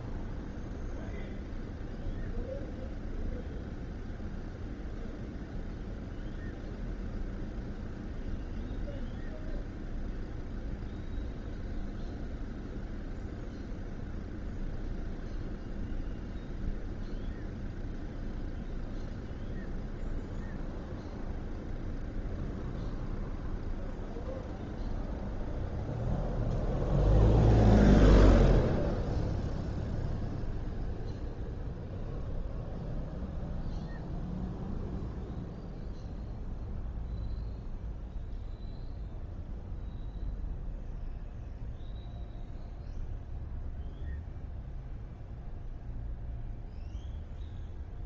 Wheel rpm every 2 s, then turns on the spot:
0, 0, 0, 0, 0, 0, 0, 0, 0, 0, 0, 0, 0, 0, 0, 0, 0, 0, 0, 0, 0, 0, 0, 0.
none